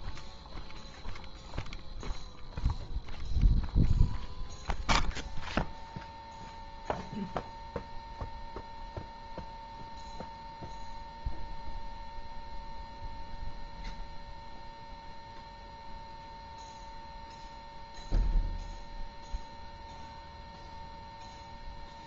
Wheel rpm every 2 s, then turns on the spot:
0, 0, 0, 0, 0, 0, 0, 0, 0, 0, 0.
none